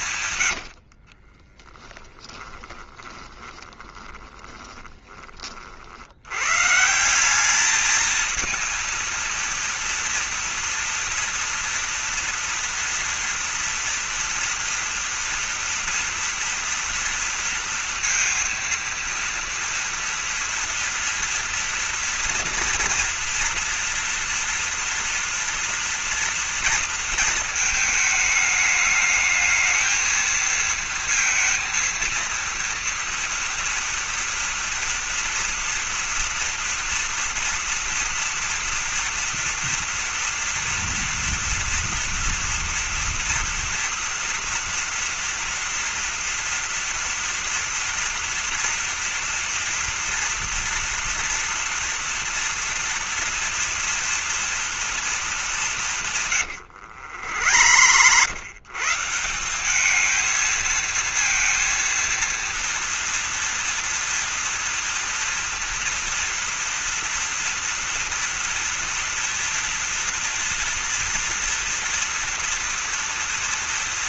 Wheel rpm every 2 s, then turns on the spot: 90, 10, 20, 120, 230, 240, 230, 230, 230, 230, 230, 230, 240, 230, 210, 230, 230, 230, 230, 230, 230, 230, 230, 230, 240, 230, 230, 230, 110, 130, 220, 230, 230, 230, 230, 230, 230.
0-6 56-58